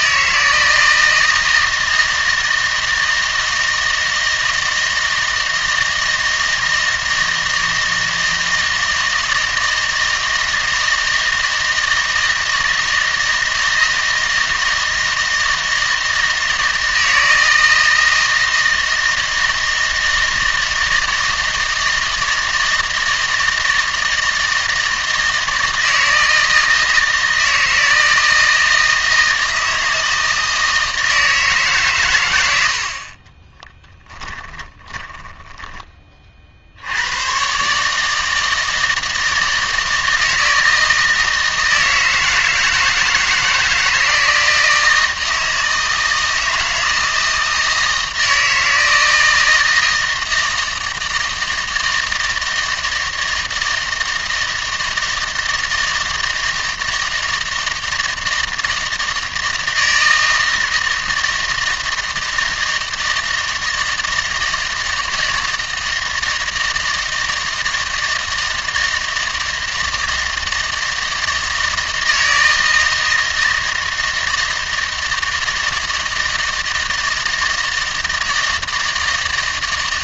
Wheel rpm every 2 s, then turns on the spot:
160, 160, 160, 160, 160, 160, 160, 160, 160, 160, 160, 160, 160, 160, 160, 160, 70, 30, 70, 160, 160, 160, 160, 160, 160, 160, 160, 160, 160, 160, 160, 160, 160, 160, 160, 160, 160, 160, 160, 160.
34-36